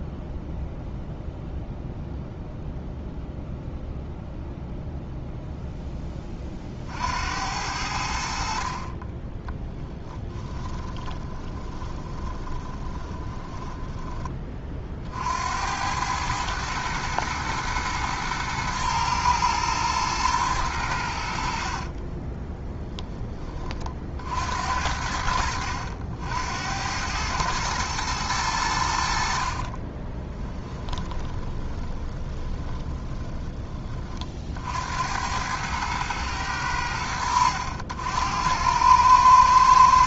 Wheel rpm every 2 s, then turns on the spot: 0, 0, 0, 60, 40, 20, 10, 40, 110, 110, 100, 10, 80, 90, 70, 20, 20, 70, 90, 100.
10-14 30-34